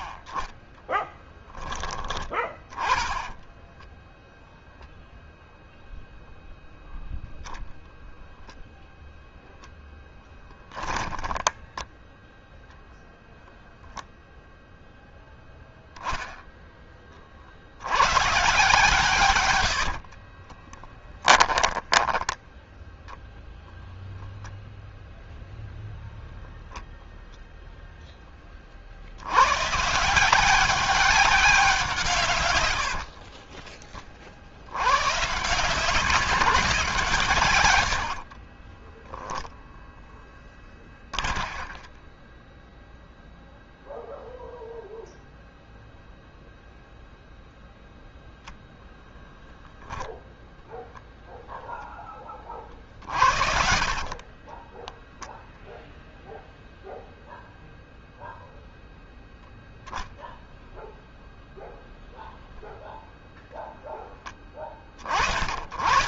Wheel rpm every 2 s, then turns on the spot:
20, 10, 0, 0, 10, 10, 0, 0, 10, 130, 30, 10, 0, 0, 20, 180, 110, 60, 180, 40, 20, 20, 0, 0, 0, 0, 30, 20, 0, 0, 0, 0, 20.
10-12 20-22 38-44 54-56